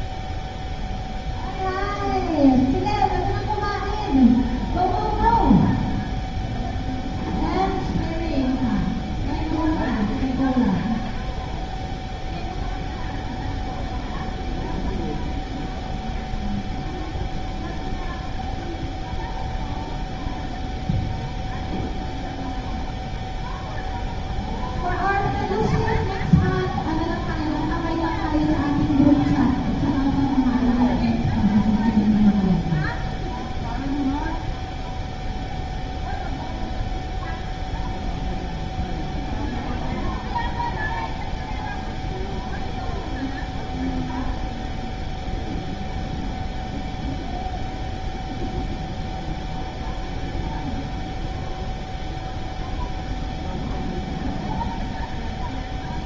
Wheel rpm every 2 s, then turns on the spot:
0, 0, 0, 0, 0, 0, 0, 0, 0, 0, 0, 0, 0, 0, 0, 0, 0, 0, 0, 0, 0, 0, 0, 0, 0, 0, 0, 0.
none